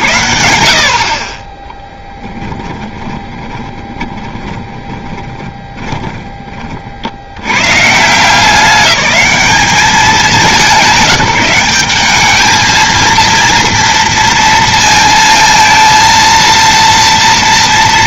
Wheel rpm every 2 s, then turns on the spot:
70, 10, 10, 40, 200, 190, 220, 230, 230.
2-6